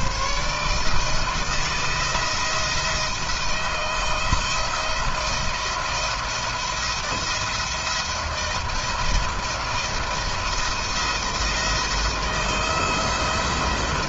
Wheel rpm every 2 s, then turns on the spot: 140, 170, 170, 170, 170, 170, 170.
none